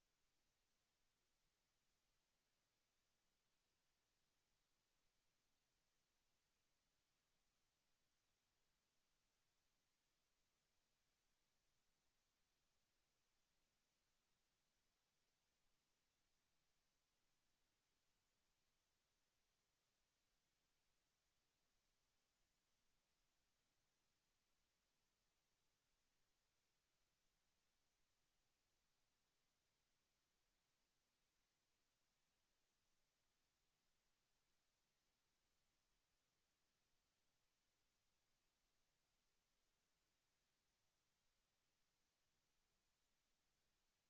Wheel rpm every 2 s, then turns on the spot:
0, 0, 0, 0, 0, 0, 0, 0, 0, 0, 0, 0, 0, 0, 0, 0, 0, 0, 0, 0, 0, 0.
none